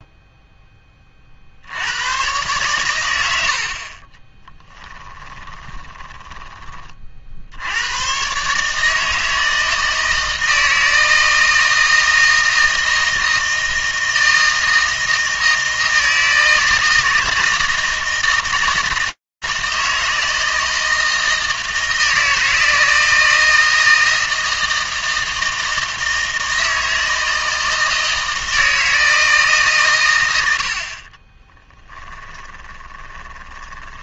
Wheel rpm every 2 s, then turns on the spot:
10, 130, 10, 20, 140, 160, 160, 160, 160, 160, 160, 160, 160, 160, 160, 40, 20.
4-6 30-34